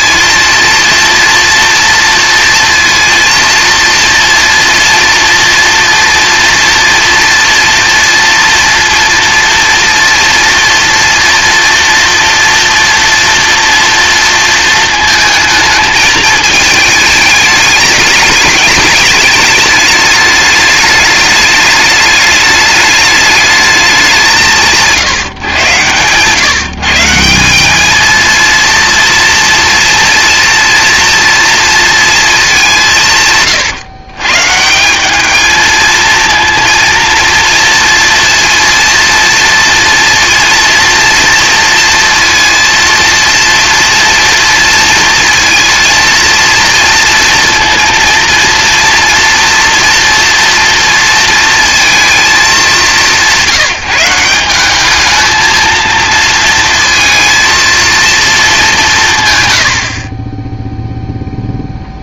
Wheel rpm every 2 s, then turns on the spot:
230, 230, 230, 230, 240, 240, 230, 230, 220, 210, 210, 210, 160, 150, 230, 230, 180, 160, 230, 230, 230, 230, 230, 230, 230, 230, 200, 200, 230, 190, 0.
none